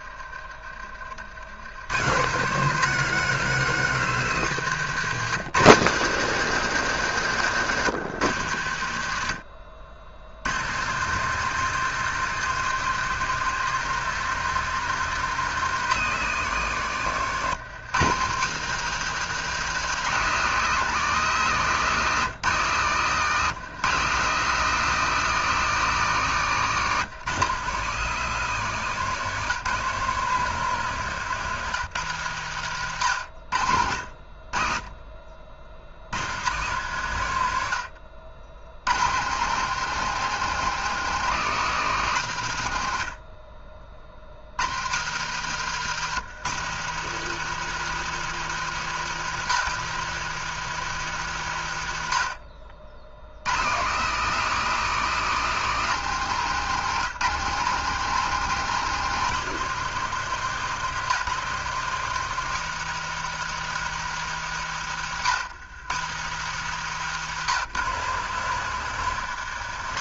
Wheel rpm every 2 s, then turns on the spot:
40, 190, 190, 200, 130, 130, 190, 200, 170, 180, 190, 160, 190, 170, 180, 160, 130, 50, 120, 90, 190, 110, 90, 170, 190, 180, 50, 190, 170, 190, 180, 190, 150, 150, 150.
0-2